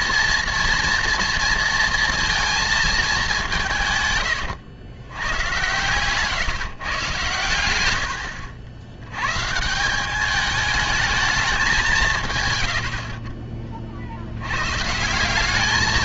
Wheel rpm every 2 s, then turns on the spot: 230, 220, 110, 130, 70, 210, 110, 120.
12-14